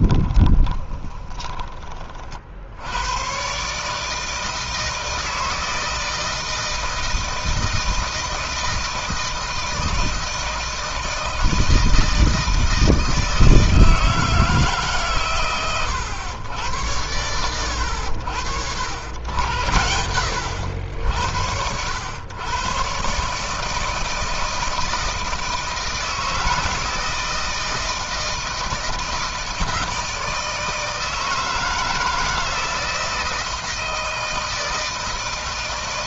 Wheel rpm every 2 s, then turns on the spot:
20, 60, 160, 160, 160, 160, 160, 150, 100, 90, 80, 120, 160, 160, 160, 160, 160, 160.
0-2